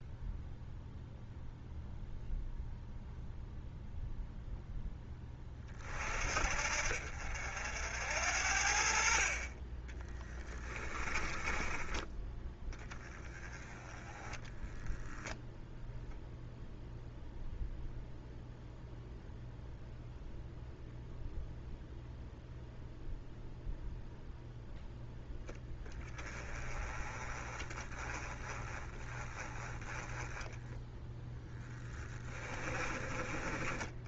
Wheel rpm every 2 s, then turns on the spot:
0, 0, 0, 50, 50, 20, 20, 0, 0, 0, 0, 0, 0, 20, 20, 0, 20.
10-12 32-34